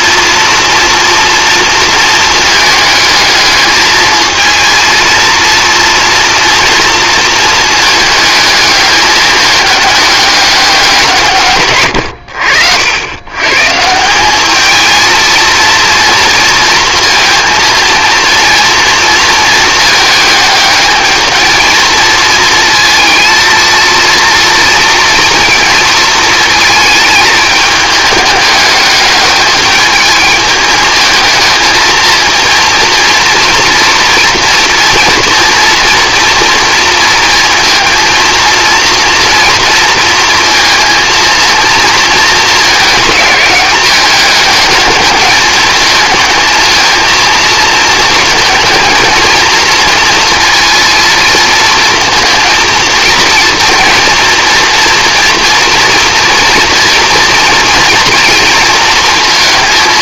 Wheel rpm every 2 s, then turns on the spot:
230, 220, 230, 230, 210, 190, 80, 220, 220, 230, 220, 220, 230, 220, 210, 220, 230, 240, 230, 240, 230, 220, 210, 220, 230, 230, 230, 240, 240, 230.
none